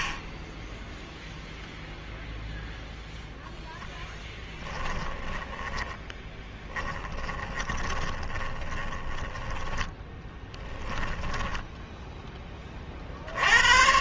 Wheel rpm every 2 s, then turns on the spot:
30, 0, 10, 10, 20, 10, 30.
0-2 4-12